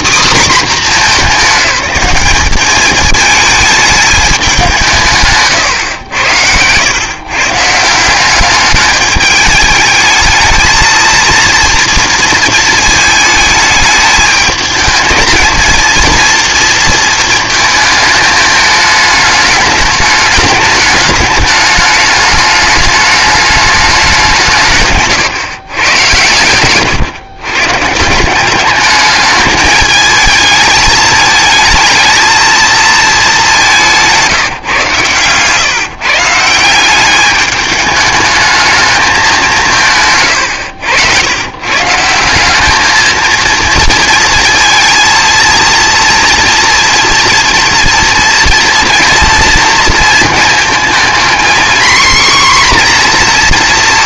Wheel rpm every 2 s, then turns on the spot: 210, 210, 150, 140, 210, 220, 220, 220, 230, 210, 210, 210, 140, 120, 210, 220, 210, 130, 200, 200, 100, 220, 230, 240, 230, 230, 250.
34-36